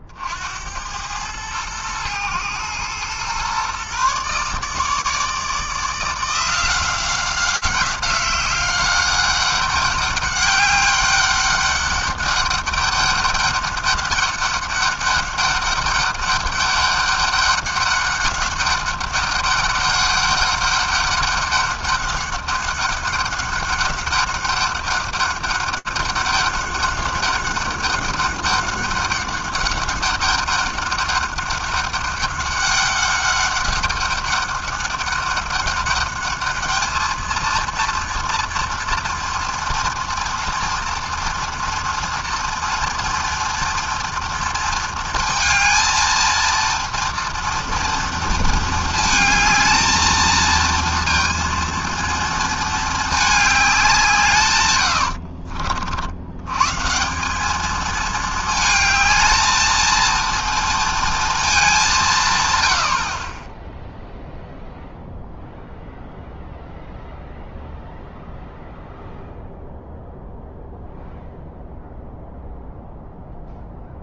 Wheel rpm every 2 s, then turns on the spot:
80, 110, 140, 180, 190, 200, 200, 200, 200, 200, 200, 200, 200, 200, 200, 200, 200, 200, 210, 230, 230, 230, 230, 230, 230, 220, 220, 120, 110, 220, 230, 120, 0, 0, 0, 0, 0.
none